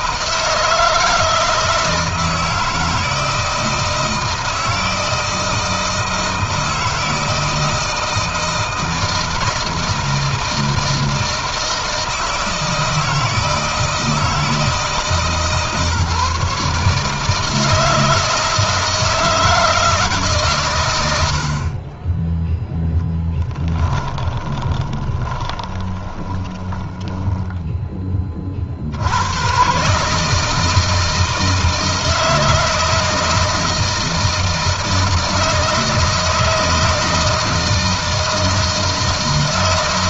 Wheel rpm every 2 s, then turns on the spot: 160, 160, 160, 160, 160, 160, 160, 150, 150, 160, 120, 10, 20, 10, 50, 160, 160, 160, 160, 160.
24-28